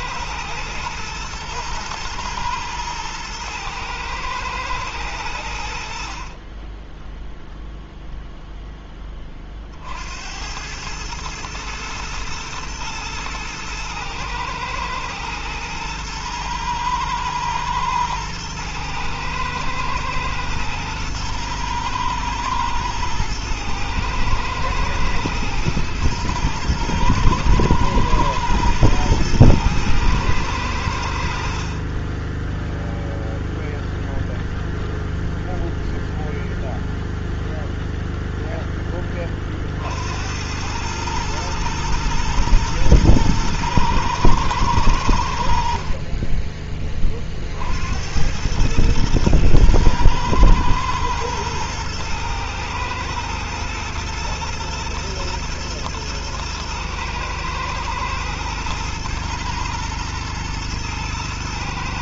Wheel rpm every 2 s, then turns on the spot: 110, 110, 100, 10, 10, 100, 110, 110, 110, 110, 110, 110, 110, 110, 110, 80, 0, 0, 0, 20, 110, 110, 90, 30, 110, 110, 110, 120, 110, 120, 120.
30-32